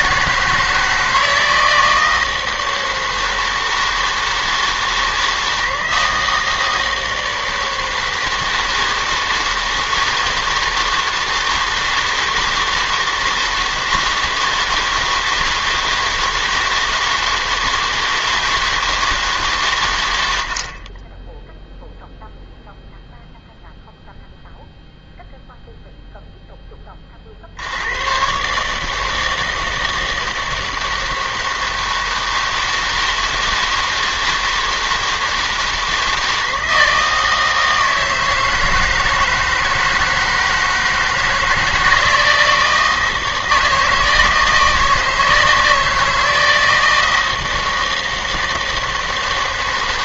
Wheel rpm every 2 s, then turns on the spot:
160, 160, 160, 160, 160, 160, 160, 160, 160, 160, 40, 0, 0, 20, 150, 160, 160, 160, 160, 160, 160, 160, 160, 160, 160.
none